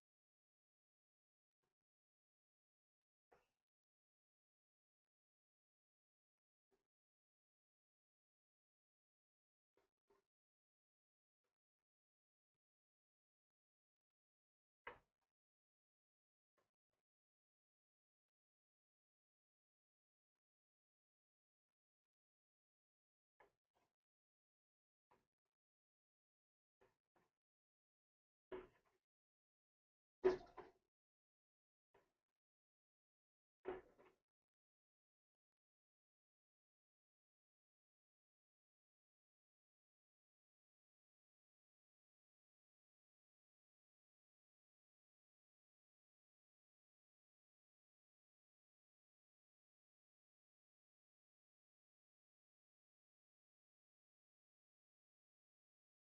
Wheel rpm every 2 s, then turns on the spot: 0, 0, 0, 0, 0, 0, 0, 0, 0, 0, 0, 0, 0, 0, 0, 0, 0, 0, 0, 0, 0, 0, 0, 0, 0, 0, 0, 0.
none